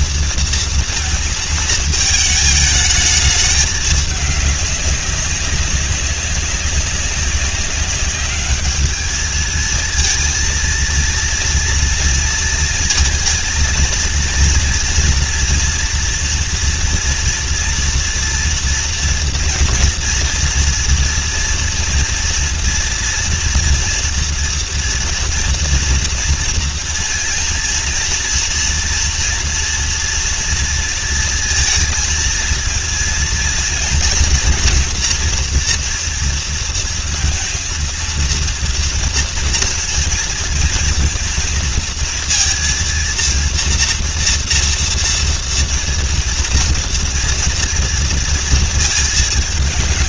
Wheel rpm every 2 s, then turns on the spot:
230, 220, 200, 200, 210, 230, 230, 240, 230, 230, 240, 240, 230, 230, 230, 230, 230, 240, 230, 230, 230, 230, 230, 230, 230.
none